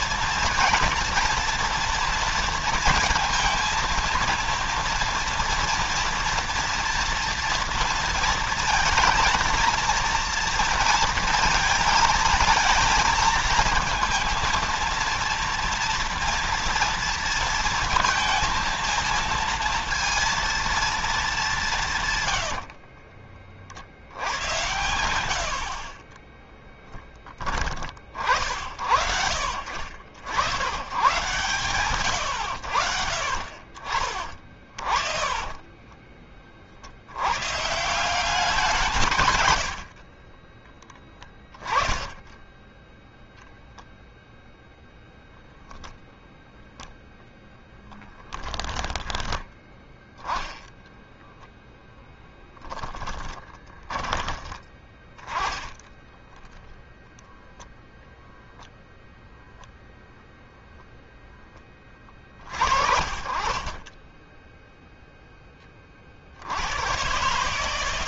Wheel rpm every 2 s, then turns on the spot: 230, 230, 230, 230, 230, 230, 220, 230, 230, 230, 230, 90, 90, 10, 70, 100, 100, 30, 40, 170, 10, 10, 0, 0, 10, 10, 10, 10, 0, 0, 0, 50, 10, 100.
22-24 34-36 40-44 48-50 52-54